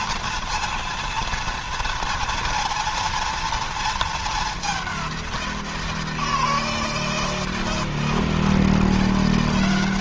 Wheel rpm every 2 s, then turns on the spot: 230, 230, 210, 170, 170.
none